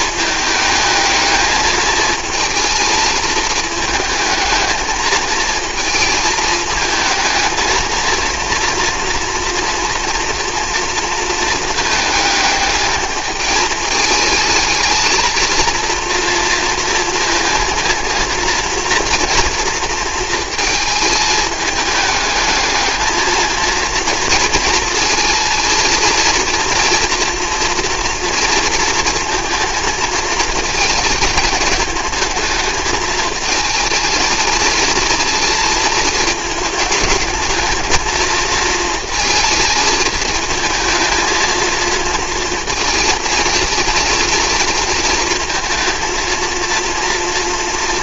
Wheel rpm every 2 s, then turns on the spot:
220, 220, 220, 220, 230, 230, 210, 220, 230, 230, 220, 210, 230, 230, 230, 230, 220, 230, 220, 230, 220, 230, 230, 230.
none